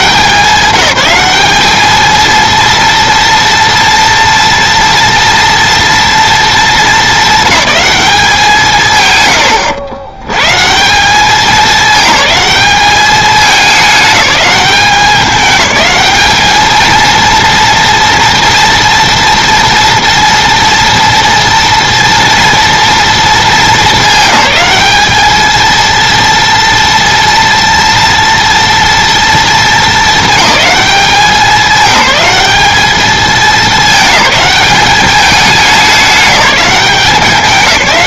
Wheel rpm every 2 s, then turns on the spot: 190, 230, 230, 210, 140, 180, 210, 200, 230, 240, 230, 230, 200, 230, 230, 210, 210, 200, 190.
none